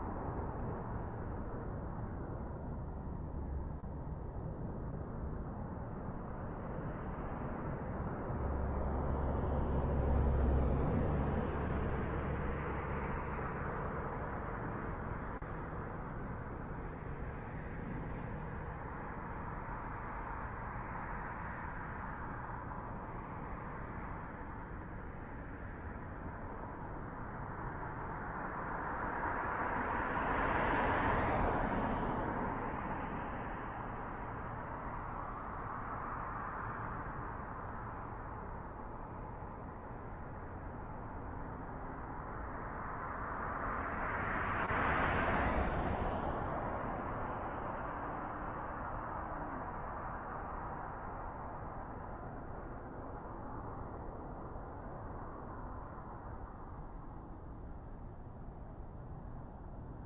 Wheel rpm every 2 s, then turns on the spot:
0, 0, 0, 0, 0, 0, 0, 0, 0, 0, 0, 0, 0, 0, 0, 0, 0, 0, 0, 0, 0, 0, 0, 0, 0, 0, 0, 0, 0, 0.
none